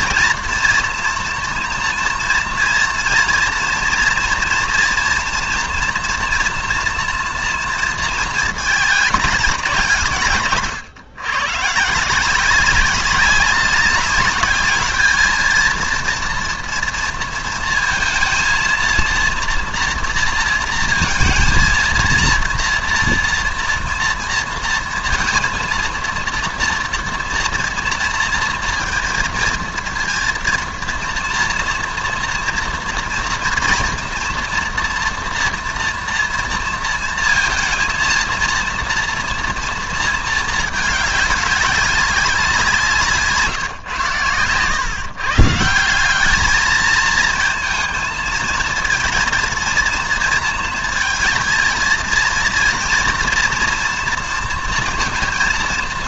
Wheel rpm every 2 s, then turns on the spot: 230, 230, 230, 230, 220, 130, 190, 210, 230, 230, 230, 230, 230, 230, 230, 230, 240, 230, 230, 230, 220, 180, 120, 220, 230, 230, 240, 230.
none